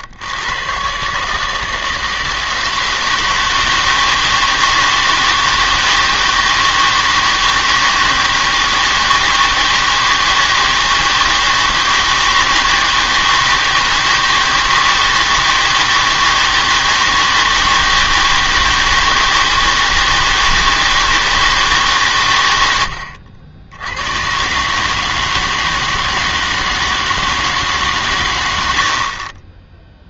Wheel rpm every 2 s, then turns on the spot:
110, 160, 160, 160, 160, 160, 160, 160, 160, 160, 160, 100, 140, 160, 90.
none